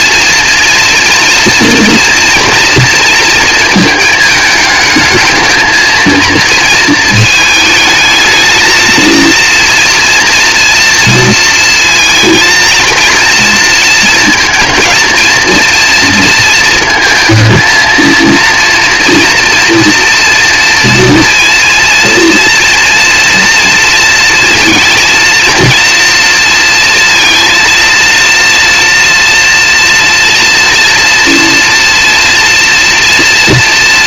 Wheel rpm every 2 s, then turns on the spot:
230, 230, 220, 230, 220, 230, 230, 220, 230, 230, 230, 230, 230, 230, 230, 230, 230.
none